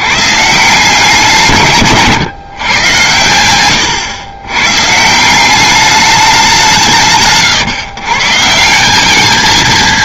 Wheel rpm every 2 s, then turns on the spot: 140, 120, 120, 190, 160.
none